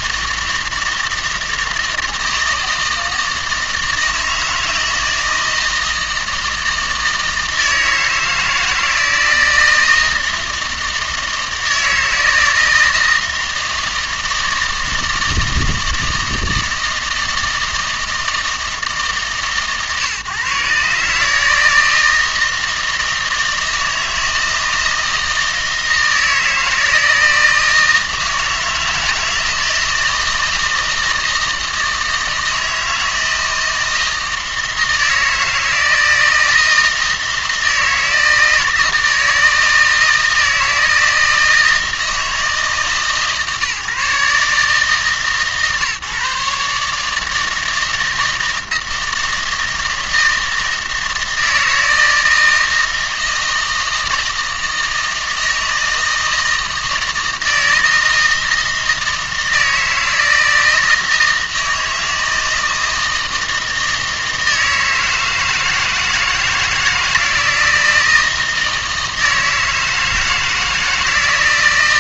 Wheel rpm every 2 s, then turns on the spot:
160, 160, 160, 160, 160, 160, 160, 160, 160, 160, 140, 160, 160, 160, 160, 160, 160, 160, 160, 160, 160, 160, 150, 150, 160, 160, 160, 160, 160, 160, 160, 160, 160, 160, 160, 160.
none